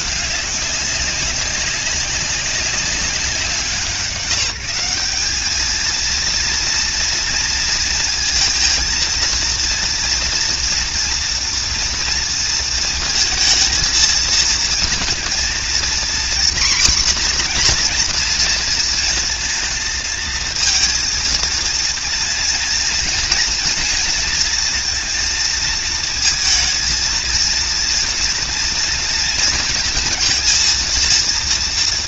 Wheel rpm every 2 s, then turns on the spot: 190, 180, 190, 230, 230, 230, 230, 230, 250, 230, 230, 230, 230, 230, 230, 230.
none